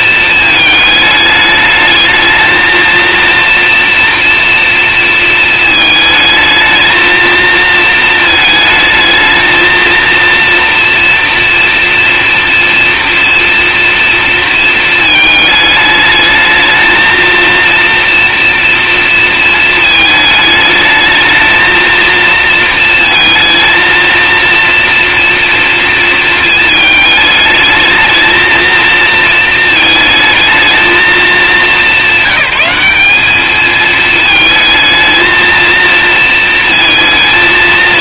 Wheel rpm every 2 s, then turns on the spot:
220, 230, 240, 220, 220, 230, 230, 230, 220, 230, 220, 230, 240, 220, 230, 220, 190, 220, 230.
none